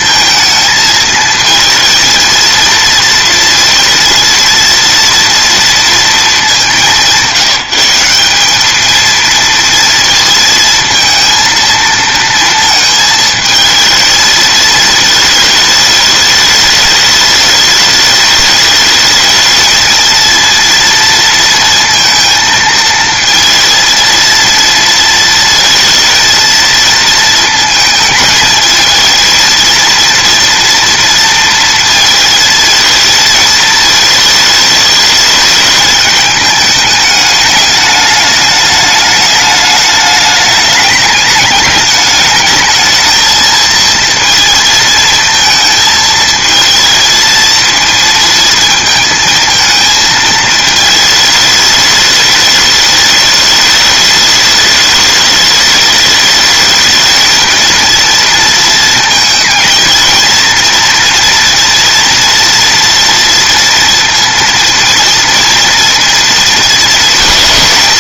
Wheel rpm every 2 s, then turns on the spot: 230, 230, 230, 230, 180, 230, 230, 220, 210, 210, 230, 230, 230, 220, 220, 230, 230, 220, 220, 210, 210, 210, 230, 220, 230, 220, 210, 210, 210, 230, 230, 230, 230, 230.
none